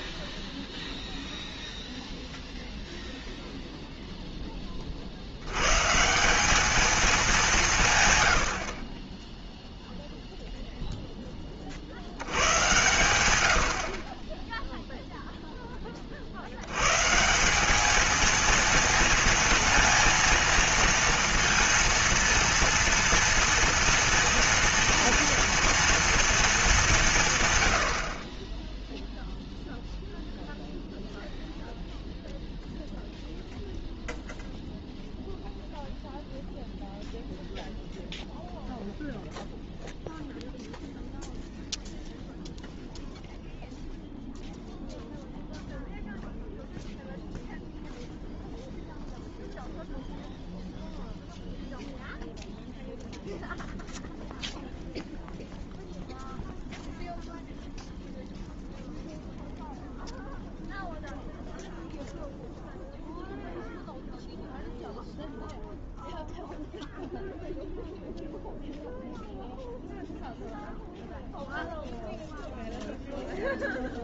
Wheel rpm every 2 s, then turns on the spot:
0, 0, 20, 200, 90, 0, 100, 10, 80, 220, 230, 230, 230, 220, 30, 0, 0, 0, 0, 0, 0, 0, 0, 0, 0, 0, 0, 0, 0, 0, 0, 0, 0, 0, 0, 0, 0.
none